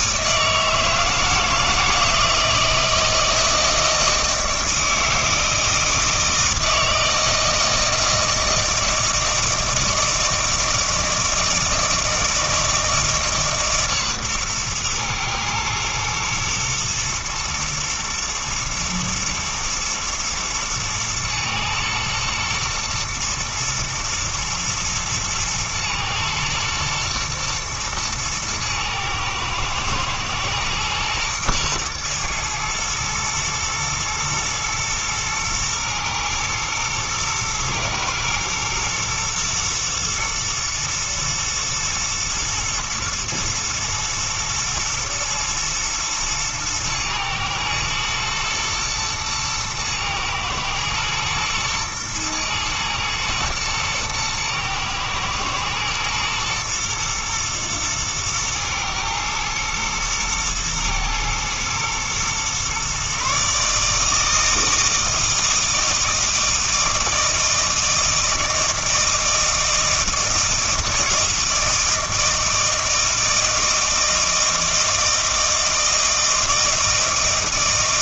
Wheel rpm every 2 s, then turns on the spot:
160, 160, 160, 160, 160, 160, 160, 120, 120, 120, 110, 110, 110, 120, 110, 110, 110, 110, 120, 110, 120, 110, 120, 110, 110, 110, 110, 120, 120, 110, 110, 130, 160, 160, 160, 160, 160, 160, 160.
none